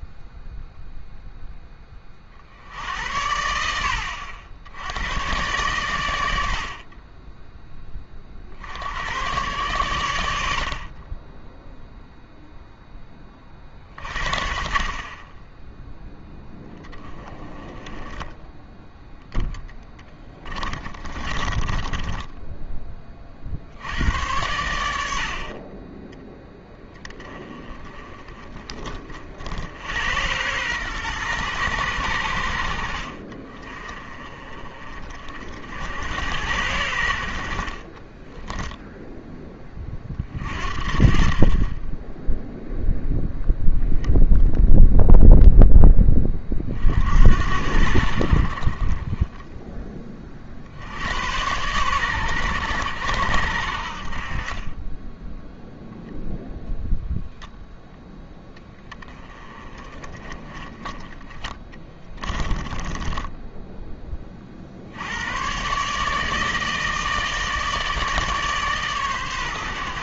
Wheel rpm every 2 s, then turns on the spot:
0, 60, 90, 50, 70, 50, 10, 40, 20, 10, 30, 20, 90, 10, 30, 110, 60, 40, 80, 0, 40, 0, 0, 40, 50, 60, 90, 30, 0, 10, 20, 20, 70, 160, 140.
20-22 62-64